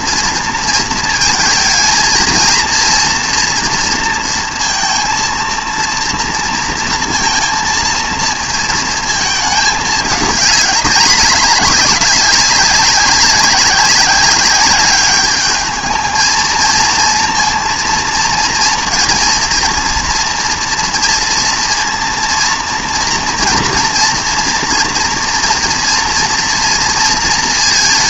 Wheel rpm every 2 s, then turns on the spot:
230, 230, 230, 230, 230, 210, 200, 200, 230, 230, 230, 230, 230, 230.
none